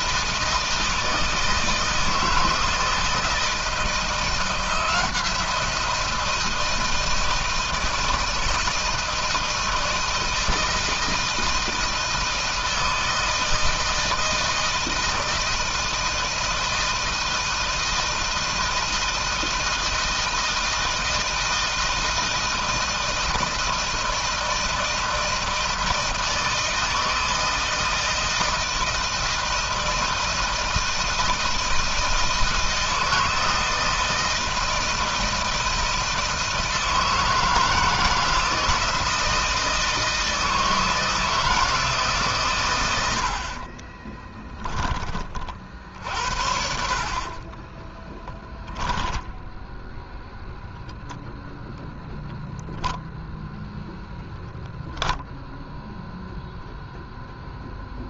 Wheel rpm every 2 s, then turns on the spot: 160, 160, 170, 160, 160, 160, 160, 160, 160, 160, 160, 160, 160, 160, 160, 160, 160, 160, 160, 160, 160, 110, 10, 60, 10, 0, 10, 0, 0.
46-50